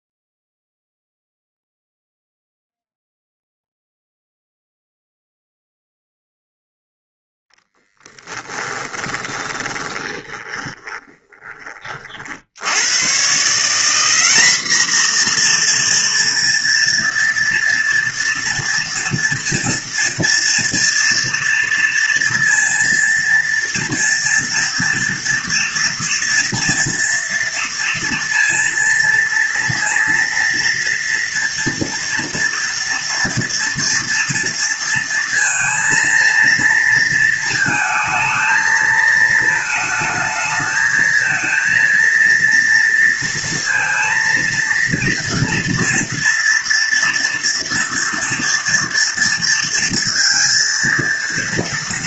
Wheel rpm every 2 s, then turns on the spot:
0, 0, 0, 0, 10, 20, 90, 230, 240, 230, 240, 230, 230, 230, 230, 240, 230, 230, 230, 220, 220, 230, 230, 230, 230, 230.
8-12